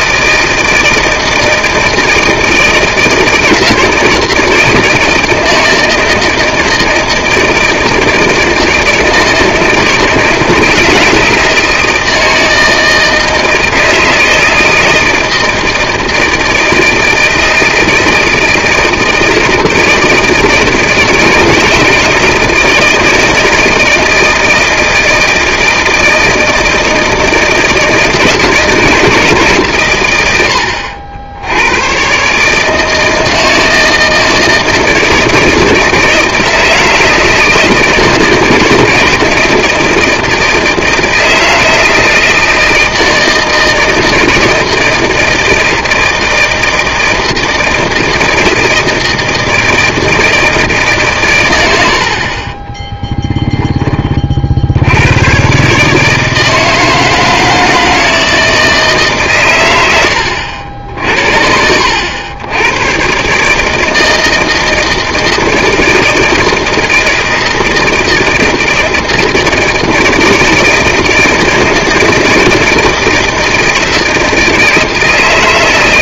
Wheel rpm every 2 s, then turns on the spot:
160, 160, 160, 160, 160, 160, 160, 160, 160, 160, 160, 170, 160, 160, 160, 70, 150, 160, 160, 160, 160, 160, 160, 160, 170, 160, 20, 70, 160, 160, 70, 110, 160, 160, 160, 160, 160, 160.
52-54